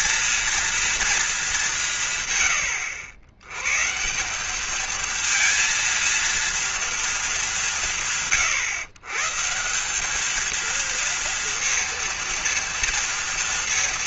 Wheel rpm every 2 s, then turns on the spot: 230, 100, 220, 230, 130, 230, 230.
none